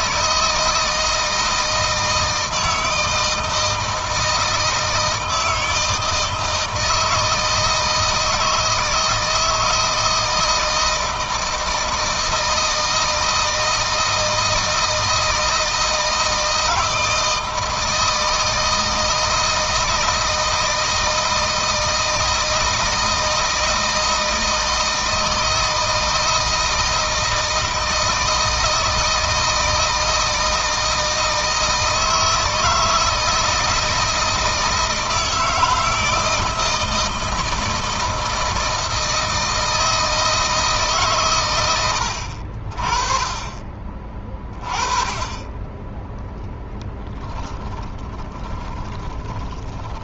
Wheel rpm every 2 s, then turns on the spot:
160, 160, 160, 160, 160, 160, 160, 160, 160, 160, 160, 160, 160, 160, 160, 160, 160, 160, 160, 160, 150, 50, 20, 10, 30.
46-50